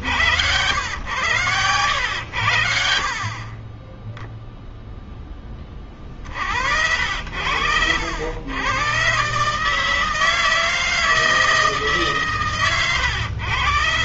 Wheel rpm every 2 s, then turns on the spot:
90, 80, 0, 70, 100, 160, 140.
none